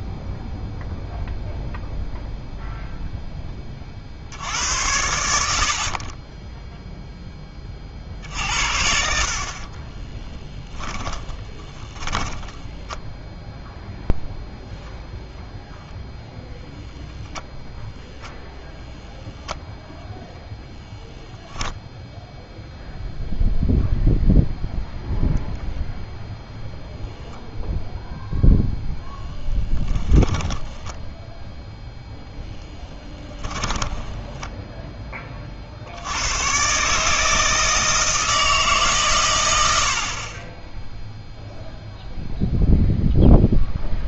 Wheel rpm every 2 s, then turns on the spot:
0, 0, 80, 0, 70, 10, 10, 0, 0, 0, 0, 0, 0, 0, 0, 10, 10, 10, 130, 150, 10, 0.
10-12 30-34